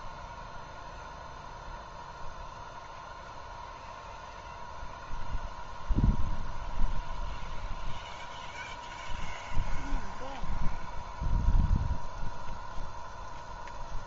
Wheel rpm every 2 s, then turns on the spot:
0, 0, 0, 0, 0, 0, 0.
none